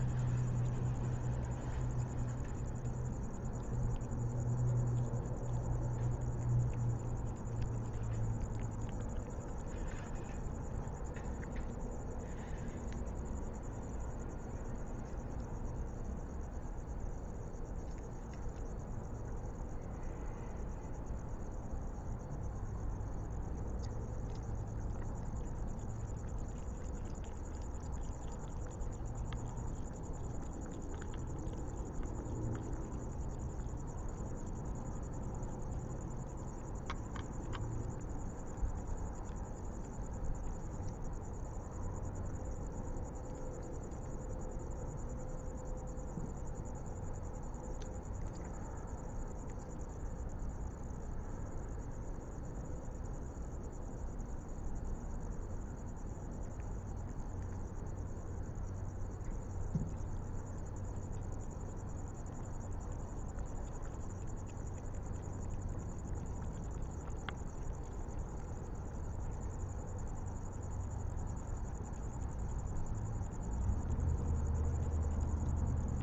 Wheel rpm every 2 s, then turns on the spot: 0, 0, 0, 0, 0, 0, 0, 0, 0, 0, 0, 0, 0, 0, 0, 0, 0, 0, 0, 0, 0, 0, 0, 0, 0, 0, 0, 0, 0, 0, 0, 0, 0, 0, 0, 0, 0, 0.
none